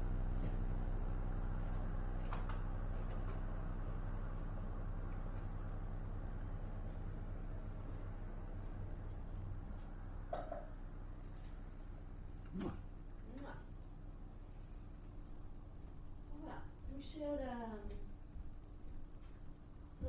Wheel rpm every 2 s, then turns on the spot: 0, 0, 0, 0, 0, 0, 0, 0, 0, 0.
none